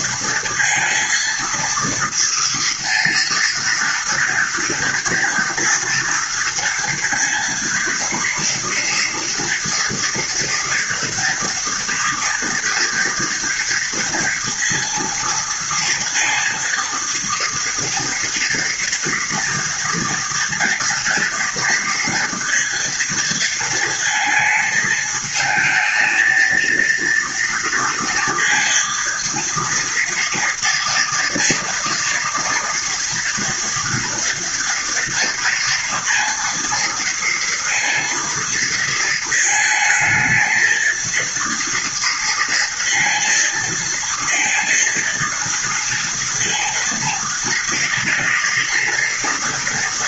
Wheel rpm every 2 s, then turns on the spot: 230, 230, 240, 230, 230, 230, 230, 230, 230, 230, 230, 230, 220, 230, 230, 230, 230, 230, 230, 220, 230, 230, 230, 230, 230.
none